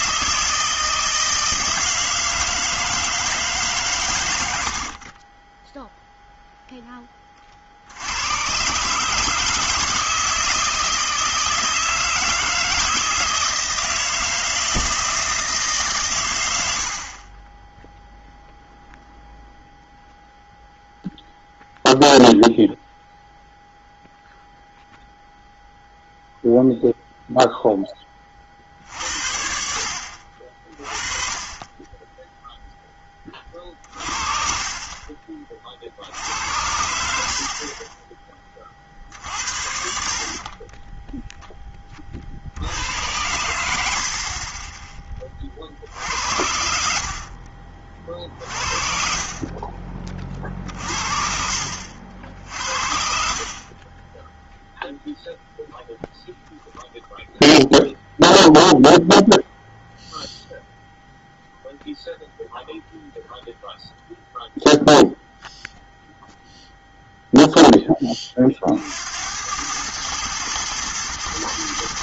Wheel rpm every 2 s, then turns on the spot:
160, 160, 60, 10, 140, 160, 170, 160, 80, 0, 0, 0, 0, 0, 60, 30, 10, 40, 70, 40, 20, 90, 20, 70, 50, 50, 50, 0, 0, 0, 0, 0, 0, 0, 70, 110.
4-6 48-50